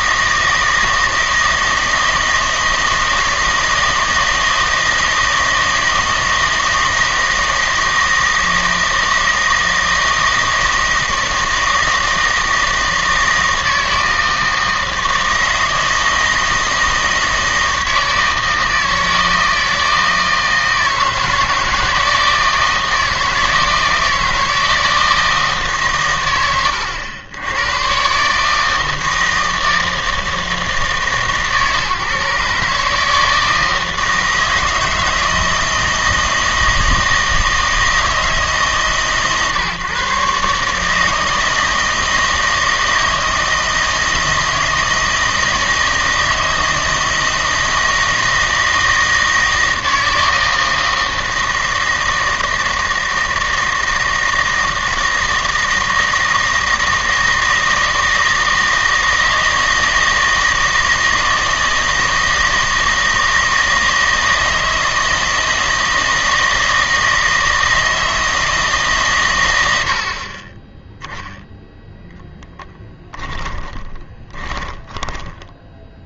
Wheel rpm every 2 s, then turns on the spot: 160, 160, 160, 160, 160, 160, 160, 160, 160, 160, 160, 160, 160, 90, 160, 160, 150, 160, 160, 140, 150, 160, 160, 160, 170, 160, 160, 160, 160, 160, 160, 160, 160, 160, 150, 10, 10, 10.
72-76